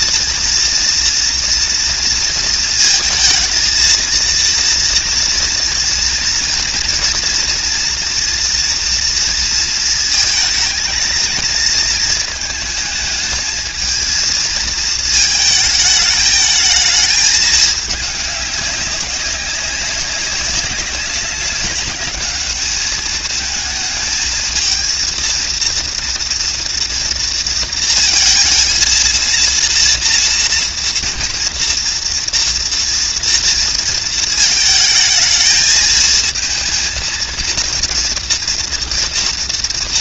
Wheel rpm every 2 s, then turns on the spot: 230, 230, 230, 230, 230, 220, 220, 230, 210, 210, 200, 210, 220, 230, 230, 230, 230, 220, 220, 230.
none